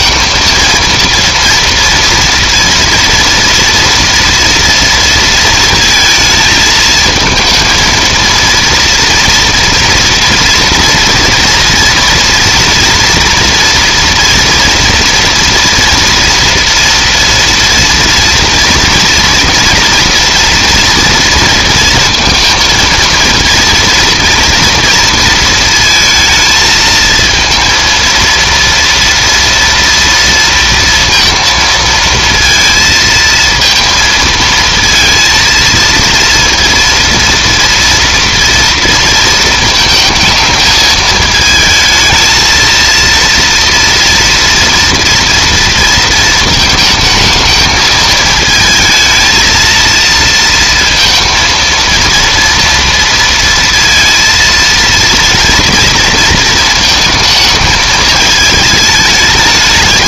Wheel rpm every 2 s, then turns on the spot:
230, 230, 230, 220, 230, 230, 230, 230, 230, 240, 240, 230, 230, 220, 230, 230, 230, 230, 230, 230, 220, 230, 230, 220, 230, 230, 230, 230, 230, 210.
none